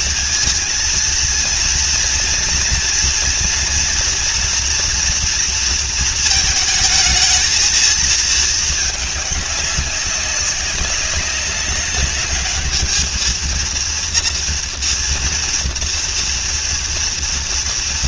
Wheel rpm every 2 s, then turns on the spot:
230, 230, 230, 220, 220, 200, 210, 230, 230.
none